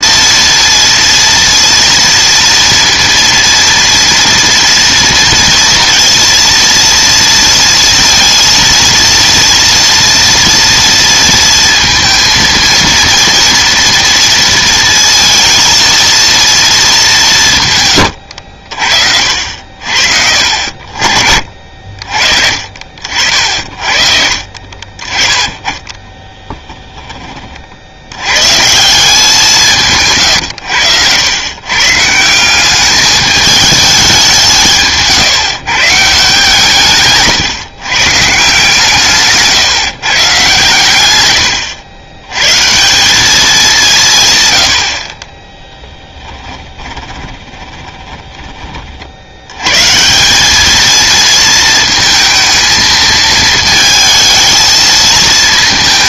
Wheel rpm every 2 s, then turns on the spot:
230, 230, 230, 230, 230, 230, 230, 230, 220, 60, 50, 50, 40, 20, 160, 100, 190, 160, 150, 150, 140, 130, 110, 20, 20, 210, 220, 220.
26-28 46-48